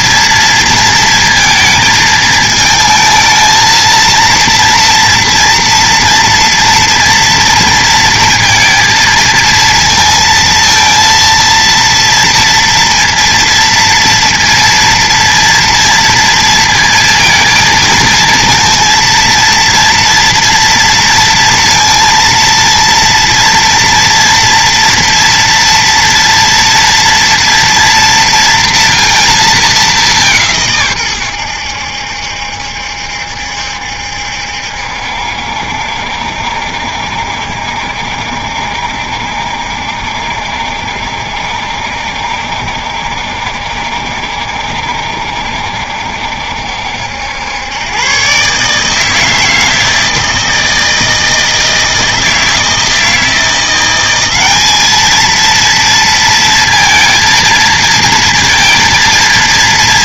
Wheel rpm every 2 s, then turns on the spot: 230, 220, 230, 230, 230, 230, 230, 230, 230, 230, 230, 230, 230, 230, 230, 150, 70, 70, 70, 70, 70, 70, 70, 70, 140, 160, 160, 200, 230, 230.
none